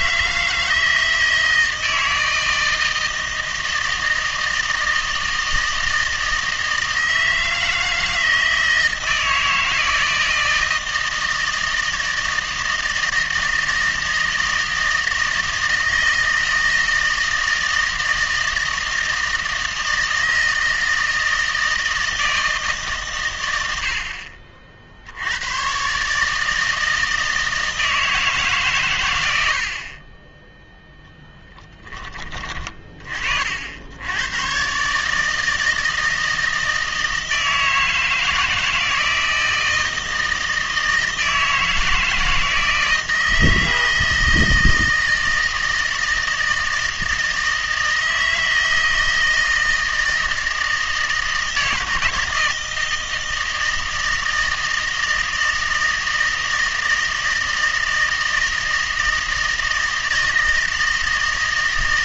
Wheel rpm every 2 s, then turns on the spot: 160, 160, 160, 160, 160, 160, 160, 160, 160, 160, 160, 150, 60, 160, 120, 0, 20, 130, 160, 160, 160, 160, 160, 160, 160, 160, 160, 160, 160, 160, 160.
none